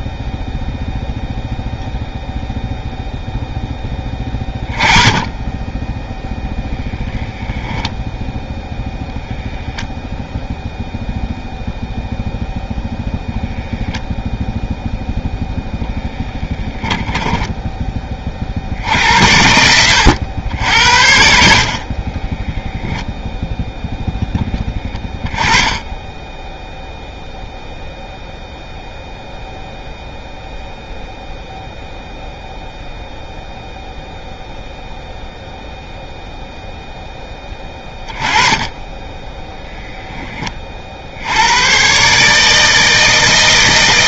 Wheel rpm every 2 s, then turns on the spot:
0, 0, 10, 0, 0, 0, 0, 0, 10, 60, 80, 10, 10, 0, 0, 0, 0, 0, 0, 20, 30, 150.
16-18 22-26 38-40